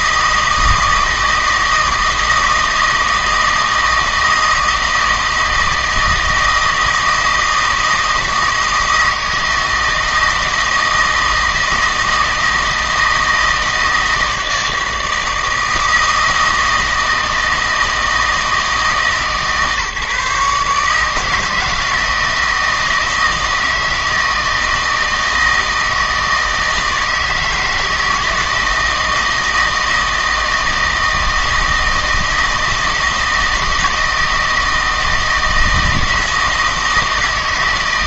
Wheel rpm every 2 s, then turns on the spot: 160, 160, 160, 160, 160, 160, 160, 160, 160, 160, 150, 160, 160, 160, 160, 160, 160, 160, 160.
none